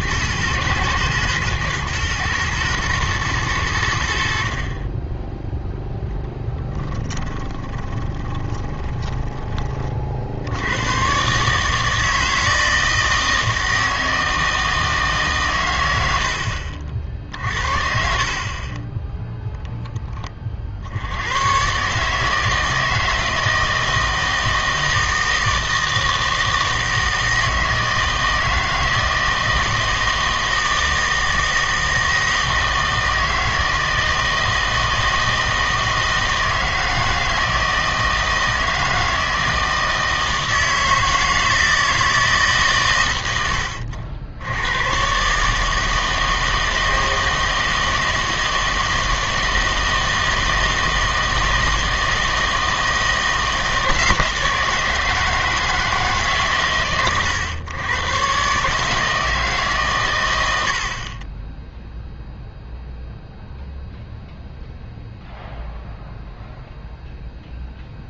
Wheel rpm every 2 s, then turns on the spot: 120, 110, 40, 10, 20, 90, 160, 160, 60, 20, 50, 160, 160, 160, 160, 160, 160, 160, 160, 160, 160, 130, 100, 160, 160, 160, 160, 160, 140, 150, 70, 0, 0, 0.
6-10